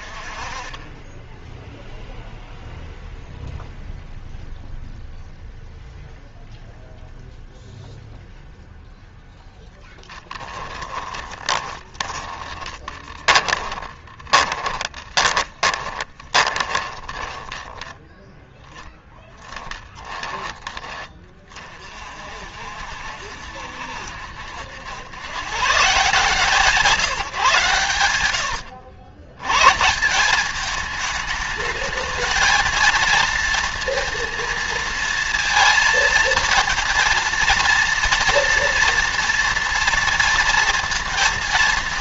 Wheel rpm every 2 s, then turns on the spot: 20, 0, 0, 0, 0, 10, 20, 20, 20, 20, 20, 60, 80, 160, 90, 200, 230, 230, 230, 230, 230.
10-22